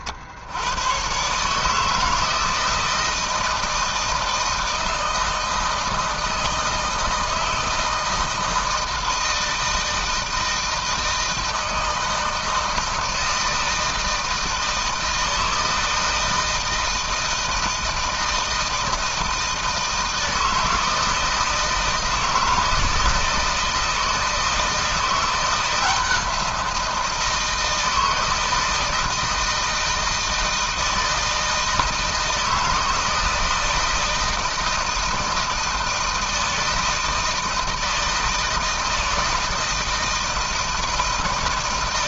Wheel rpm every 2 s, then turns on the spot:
110, 160, 160, 160, 160, 160, 160, 160, 160, 160, 160, 160, 170, 170, 160, 160, 160, 160, 160, 160, 160.
none